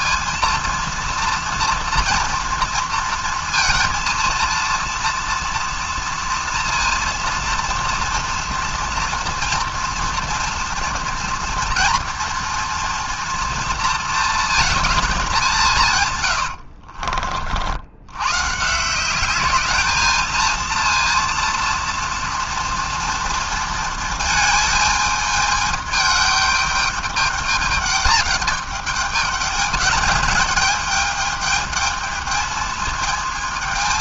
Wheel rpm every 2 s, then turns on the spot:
230, 230, 230, 230, 230, 230, 230, 220, 70, 160, 230, 230, 220, 210, 210, 210, 220.
16-18